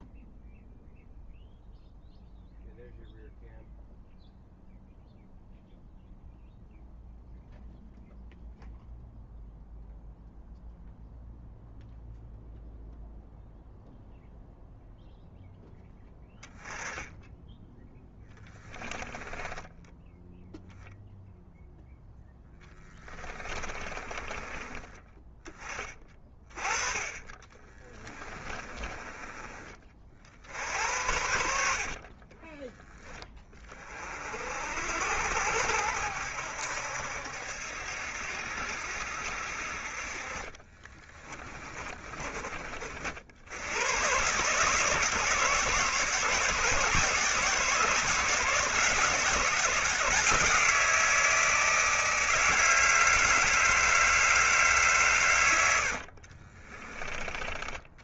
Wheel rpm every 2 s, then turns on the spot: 0, 0, 0, 0, 0, 0, 0, 0, 10, 10, 0, 10, 20, 20, 30, 80, 10, 70, 70, 60, 30, 50, 160, 170, 160, 160, 160, 130, 30.
22-24 26-28 40-42